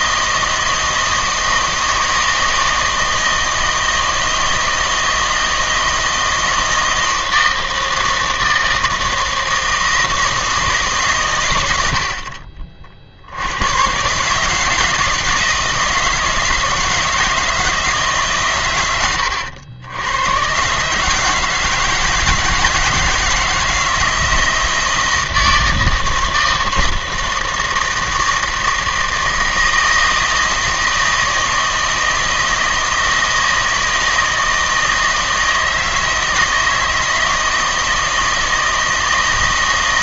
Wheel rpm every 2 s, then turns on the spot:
160, 160, 160, 160, 160, 160, 50, 160, 160, 120, 130, 160, 170, 160, 160, 160, 160, 160, 160, 160.
none